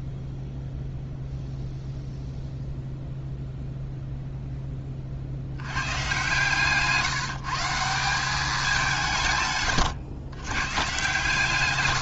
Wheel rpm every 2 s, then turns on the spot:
0, 0, 10, 140, 190, 120.
none